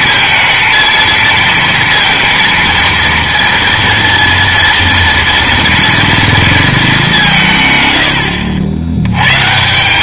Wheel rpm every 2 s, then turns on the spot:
230, 230, 230, 220, 80.
none